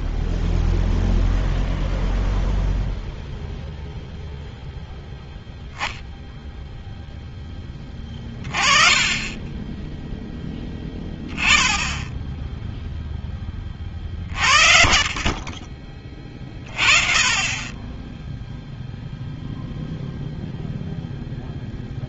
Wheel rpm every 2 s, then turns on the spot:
0, 0, 0, 30, 10, 0, 40, 30, 0, 10, 160.
6-8 12-14